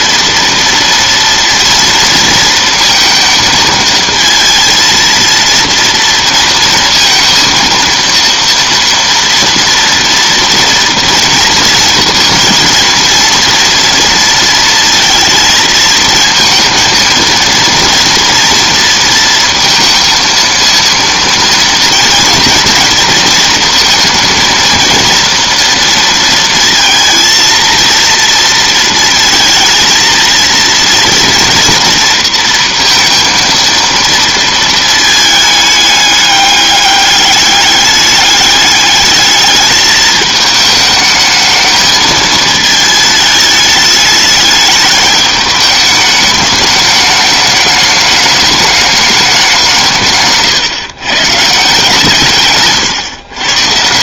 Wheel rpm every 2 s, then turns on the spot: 230, 230, 230, 230, 230, 230, 230, 230, 230, 230, 230, 230, 230, 230, 230, 230, 230, 230, 200, 210, 220, 220, 210, 210, 210, 140, 140.
none